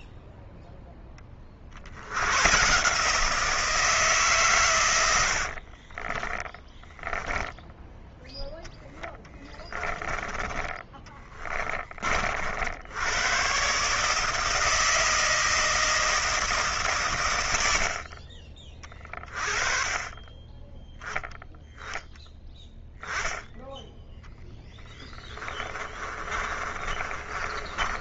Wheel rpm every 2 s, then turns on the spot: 40, 160, 40, 10, 20, 20, 120, 160, 100, 30, 10, 10, 20, 30.
4-6 8-10 24-28